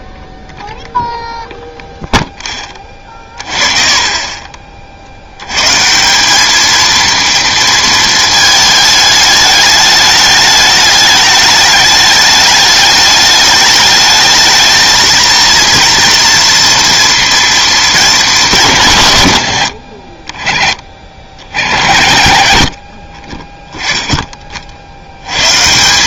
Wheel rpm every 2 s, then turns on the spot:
0, 10, 30, 200, 220, 210, 210, 220, 230, 180, 30, 70, 40.
none